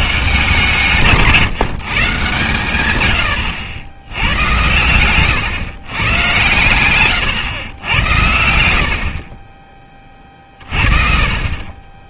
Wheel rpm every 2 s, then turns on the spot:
190, 120, 120, 110, 80, 40.
none